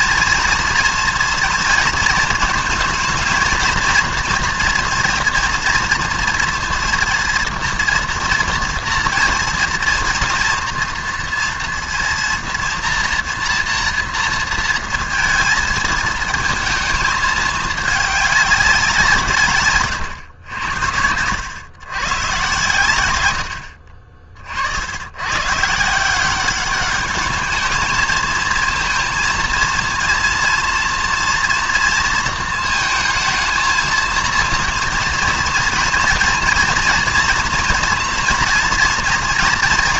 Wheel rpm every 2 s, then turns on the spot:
230, 230, 230, 230, 230, 240, 230, 230, 220, 190, 80, 110, 80, 210, 230, 230, 220, 220, 240, 230.
none